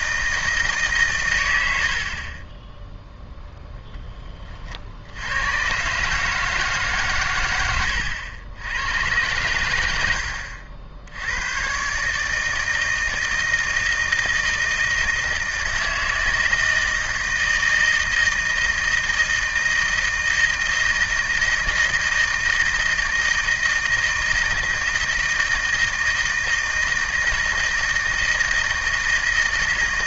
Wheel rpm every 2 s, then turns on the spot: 160, 10, 30, 150, 90, 70, 160, 160, 160, 160, 160, 160, 160, 160, 160.
none